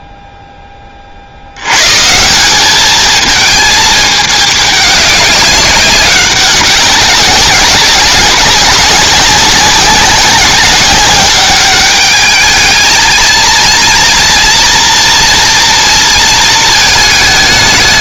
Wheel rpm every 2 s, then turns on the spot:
10, 200, 200, 190, 190, 200, 220, 230, 230.
none